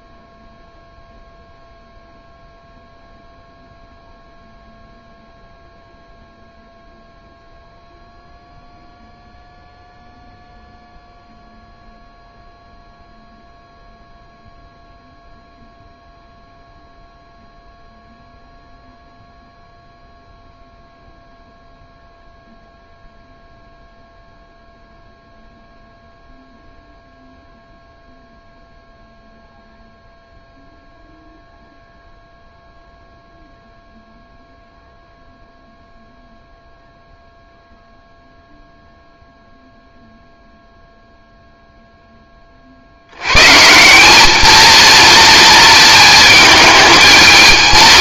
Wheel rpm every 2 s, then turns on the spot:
0, 0, 0, 0, 0, 0, 0, 0, 0, 0, 0, 0, 0, 0, 0, 0, 0, 0, 0, 0, 0, 30, 230, 220.
none